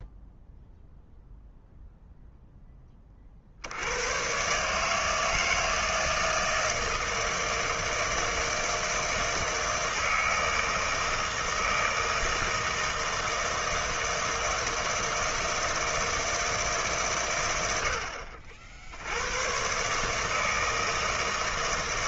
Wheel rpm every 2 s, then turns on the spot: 0, 10, 140, 160, 160, 160, 160, 160, 150, 60, 160.
none